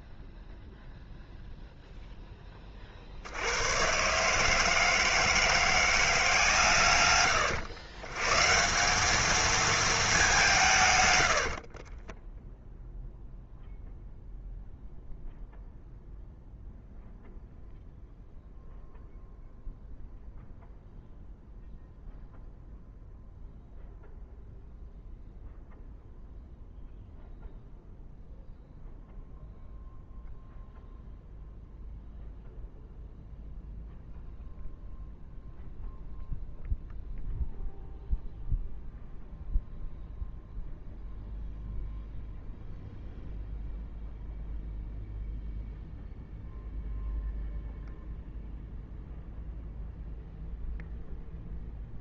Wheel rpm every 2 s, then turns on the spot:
0, 30, 160, 150, 180, 150, 0, 0, 0, 0, 0, 0, 0, 0, 0, 0, 0, 0, 0, 0, 0, 0, 0, 0, 0, 0.
none